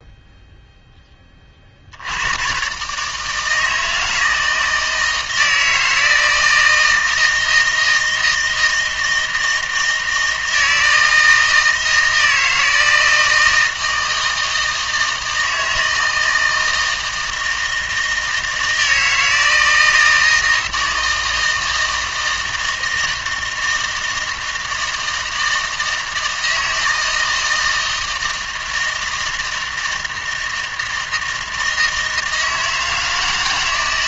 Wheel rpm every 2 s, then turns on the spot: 0, 130, 160, 160, 160, 160, 160, 160, 160, 160, 160, 160, 160, 160, 160, 160, 160.
none